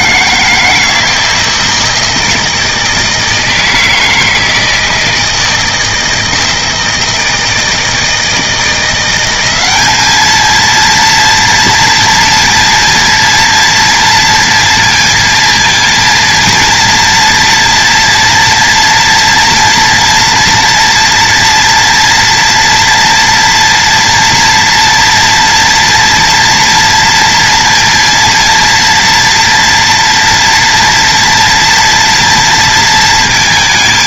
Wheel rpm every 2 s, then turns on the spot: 160, 160, 160, 160, 170, 230, 240, 230, 230, 230, 230, 230, 230, 230, 230, 230, 230.
none